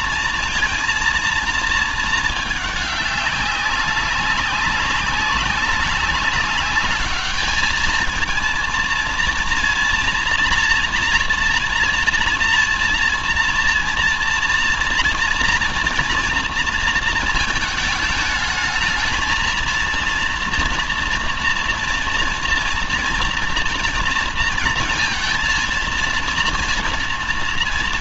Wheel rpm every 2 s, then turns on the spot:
230, 210, 200, 210, 230, 230, 230, 230, 230, 220, 230, 230, 230, 230.
none